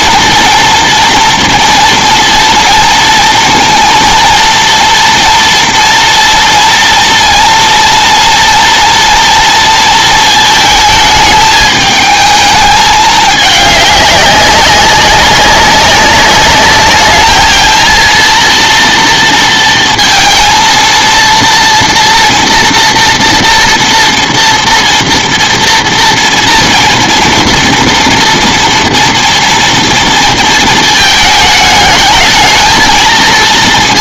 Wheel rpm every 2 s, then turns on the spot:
240, 230, 240, 230, 240, 220, 210, 190, 210, 230, 230, 240, 230, 230, 230, 230, 220.
none